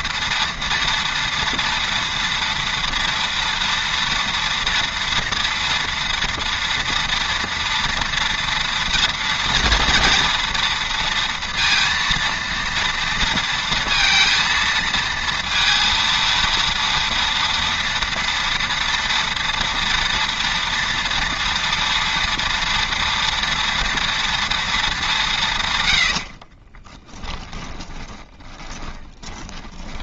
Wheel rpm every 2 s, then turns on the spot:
230, 230, 230, 230, 230, 230, 230, 230, 230, 230, 230, 240, 220, 30, 20.
26-30